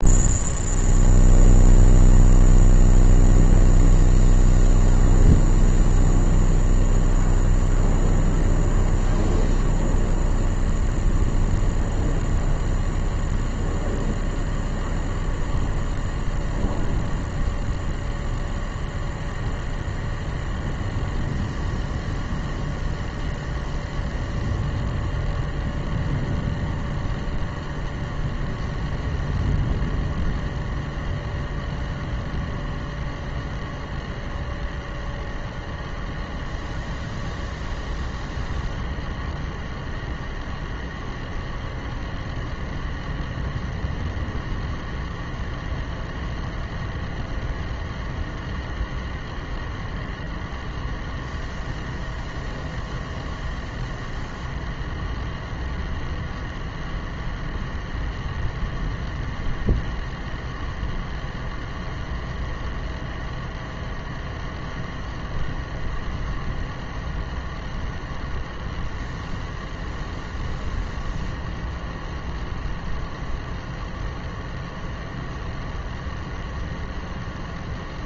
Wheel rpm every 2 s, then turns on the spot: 0, 0, 0, 0, 0, 0, 0, 0, 0, 0, 0, 0, 0, 0, 0, 0, 0, 0, 0, 0, 0, 0, 0, 0, 0, 0, 0, 0, 0, 0, 0, 0, 0, 0, 0, 0, 0, 0, 0.
none